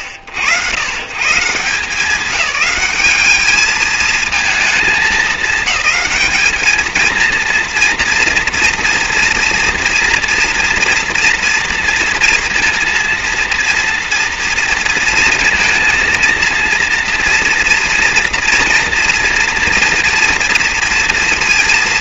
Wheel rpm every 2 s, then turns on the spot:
100, 190, 220, 220, 230, 240, 230, 230, 230, 240, 230.
none